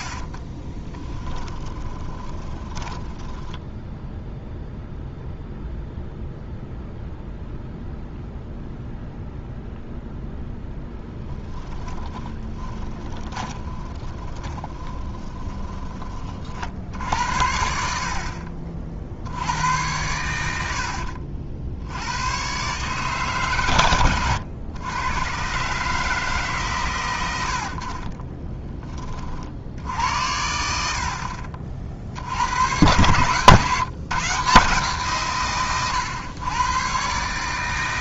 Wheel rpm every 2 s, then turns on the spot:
20, 20, 0, 0, 0, 10, 20, 20, 50, 50, 80, 130, 110, 130, 20, 70, 100, 150, 110.
0-4 10-16